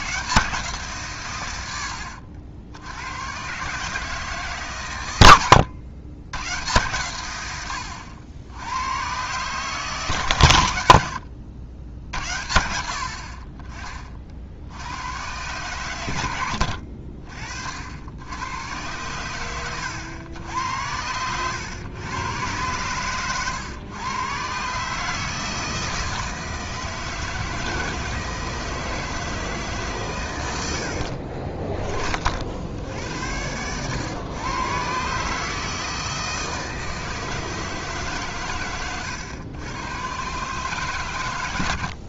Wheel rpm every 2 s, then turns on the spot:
150, 80, 130, 110, 80, 110, 60, 70, 70, 100, 100, 110, 140, 160, 160, 90, 70, 120, 160, 120, 130.
none